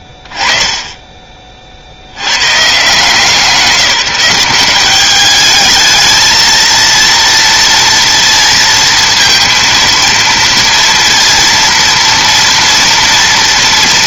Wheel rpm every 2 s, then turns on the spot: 20, 150, 200, 230, 230, 230, 230.
none